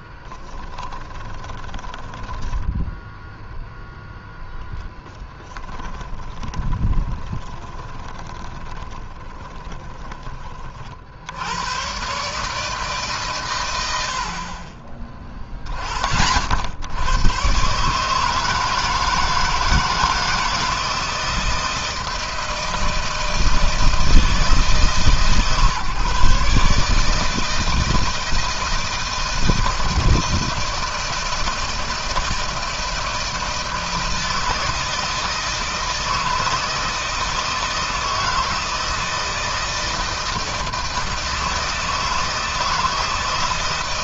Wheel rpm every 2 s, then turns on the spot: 10, 10, 10, 20, 20, 50, 140, 40, 110, 160, 160, 160, 150, 150, 160, 160, 160, 170, 160, 160, 160, 160.
0-2 6-10